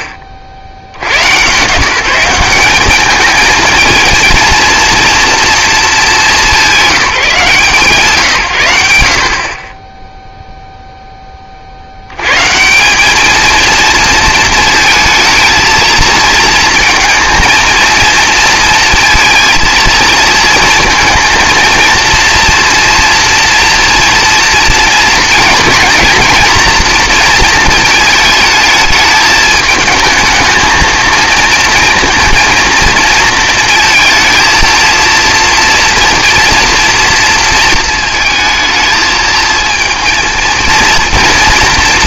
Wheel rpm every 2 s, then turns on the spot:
40, 180, 230, 190, 110, 0, 170, 220, 230, 230, 230, 230, 230, 230, 220, 220, 230, 230, 240, 220, 230.
none